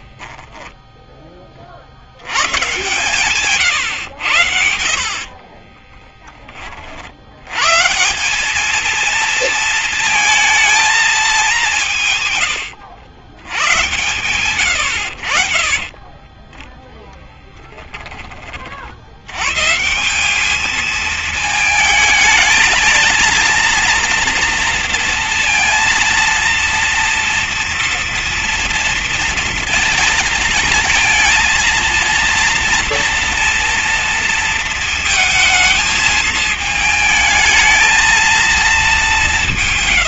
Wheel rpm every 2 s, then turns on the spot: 10, 140, 70, 50, 230, 220, 110, 80, 10, 60, 220, 220, 230, 230, 230, 220, 230, 230, 220, 200.
none